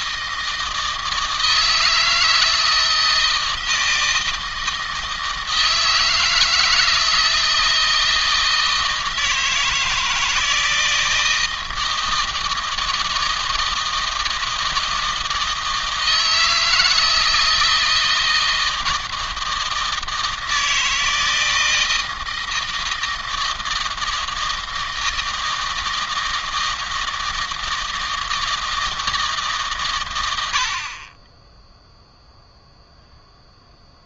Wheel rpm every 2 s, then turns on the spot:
160, 160, 160, 160, 160, 160, 160, 160, 160, 160, 160, 160, 160, 160, 160, 80, 0.
none